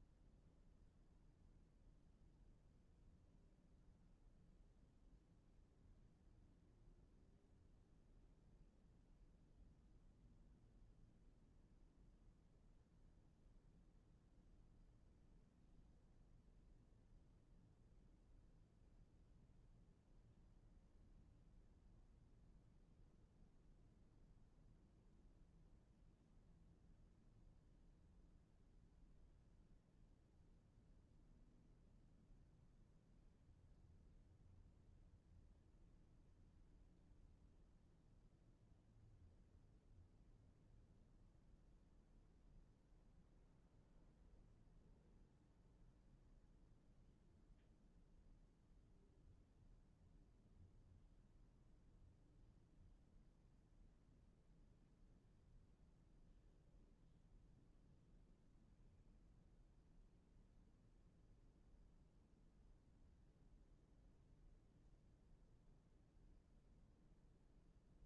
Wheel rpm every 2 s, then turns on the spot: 0, 0, 0, 0, 0, 0, 0, 0, 0, 0, 0, 0, 0, 0, 0, 0, 0, 0, 0, 0, 0, 0, 0, 0, 0, 0, 0, 0, 0, 0, 0, 0, 0, 0.
none